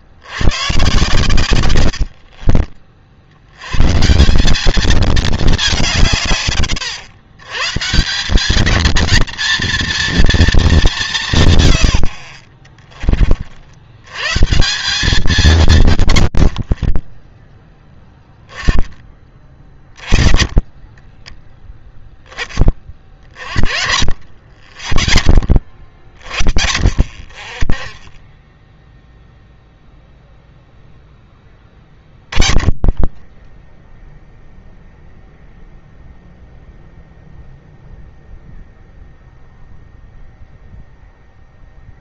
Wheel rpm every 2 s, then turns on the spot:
110, 50, 180, 140, 200, 230, 60, 150, 50, 10, 20, 20, 50, 40, 10, 0, 20, 0, 0, 0, 0.
12-14 20-22 28-30 32-34